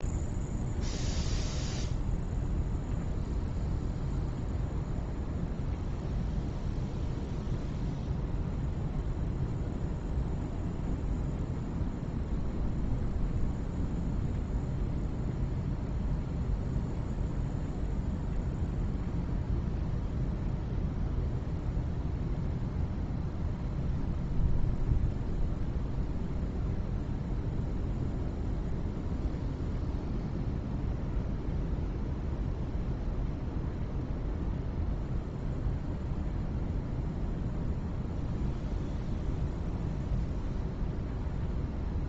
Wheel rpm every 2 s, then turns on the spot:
0, 0, 0, 0, 0, 0, 0, 0, 0, 0, 0, 0, 0, 0, 0, 0, 0, 0, 0, 0, 0.
none